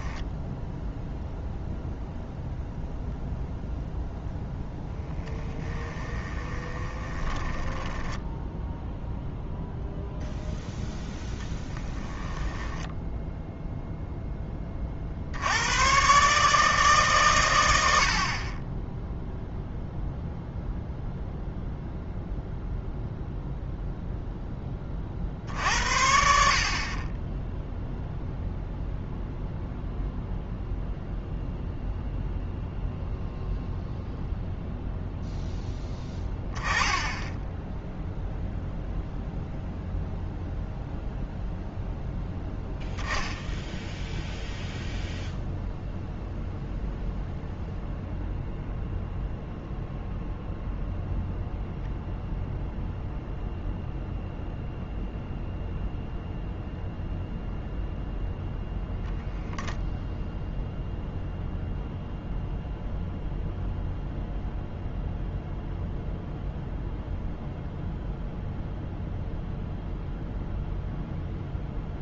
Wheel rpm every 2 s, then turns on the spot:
0, 0, 0, 20, 0, 0, 10, 30, 150, 20, 0, 0, 20, 40, 0, 0, 0, 0, 10, 0, 0, 0, 0, 0, 0, 0, 0, 0, 0, 0, 0, 0, 0, 0, 0, 0.
6-8 12-14